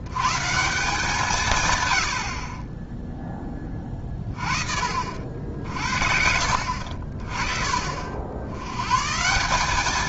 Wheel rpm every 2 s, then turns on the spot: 160, 30, 50, 60, 90.
none